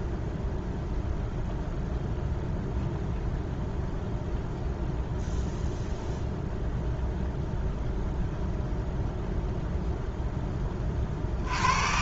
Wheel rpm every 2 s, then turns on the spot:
0, 0, 0, 0, 0, 30.
none